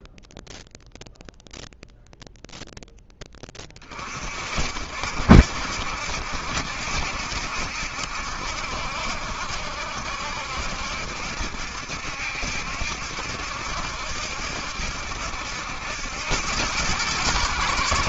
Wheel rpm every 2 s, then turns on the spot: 0, 0, 50, 70, 70, 70, 70, 70, 90.
none